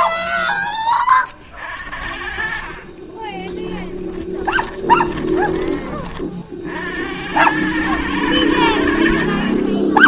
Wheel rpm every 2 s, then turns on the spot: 10, 50, 10, 50, 100.
4-6